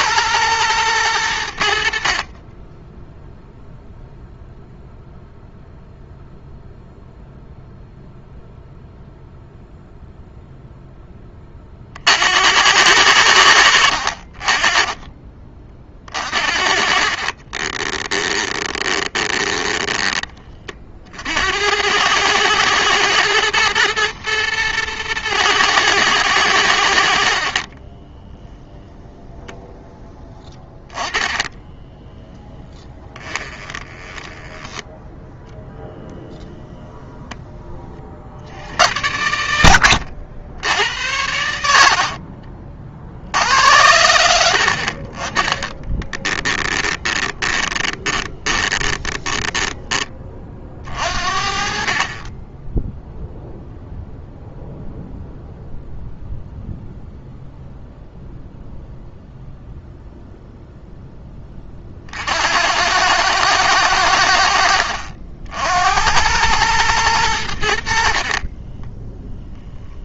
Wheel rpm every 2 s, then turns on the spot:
110, 10, 0, 0, 0, 0, 90, 20, 50, 20, 50, 110, 110, 70, 10, 20, 20, 10, 10, 70, 80, 60, 50, 20, 20, 50, 0, 0, 0, 0, 0, 90, 60, 110, 10.
16-20 30-36 46-50 68-70